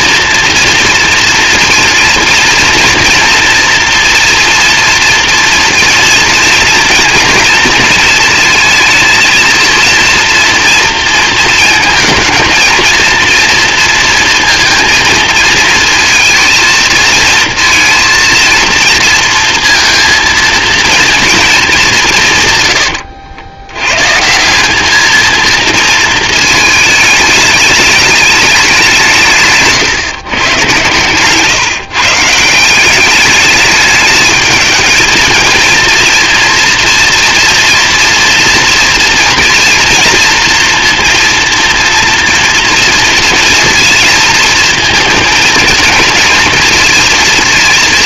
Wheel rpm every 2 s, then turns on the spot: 230, 230, 230, 230, 230, 230, 230, 230, 220, 230, 230, 110, 190, 220, 190, 120, 180, 220, 240, 230, 230, 230, 230, 220.
none